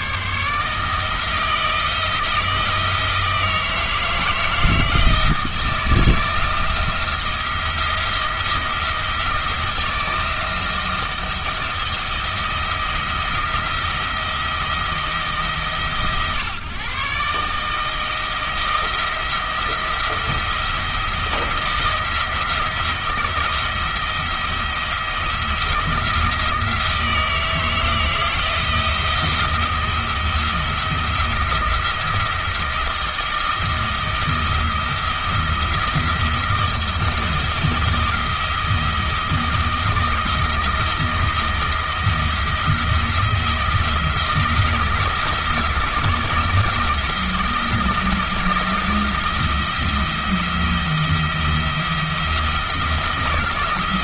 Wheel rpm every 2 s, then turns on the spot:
160, 170, 160, 160, 170, 170, 170, 170, 140, 170, 170, 160, 170, 170, 170, 170, 170, 170, 170, 170, 160, 170, 170, 170, 160, 170, 170.
none